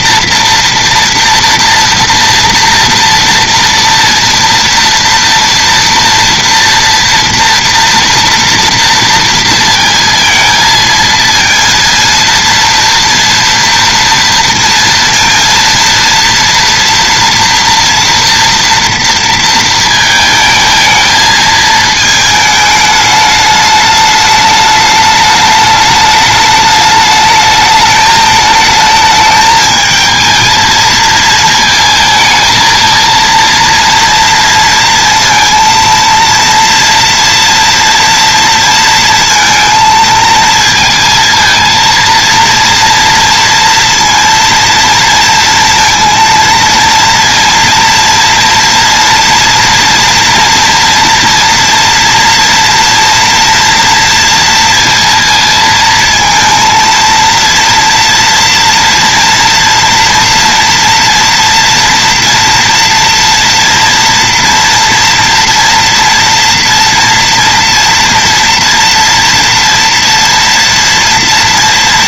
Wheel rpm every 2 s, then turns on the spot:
230, 230, 230, 240, 230, 230, 230, 230, 230, 230, 220, 220, 210, 210, 210, 220, 220, 230, 230, 230, 230, 230, 230, 230, 230, 230, 230, 230, 230, 230, 230, 230, 230, 230, 230, 230.
none